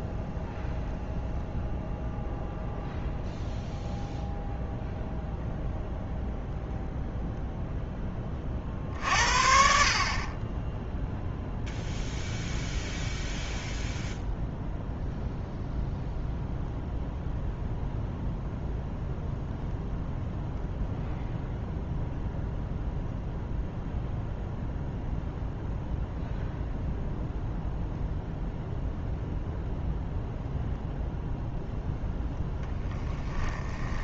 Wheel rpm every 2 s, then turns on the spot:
0, 0, 0, 0, 50, 10, 0, 0, 0, 0, 0, 0, 0, 0, 0, 0, 10.
none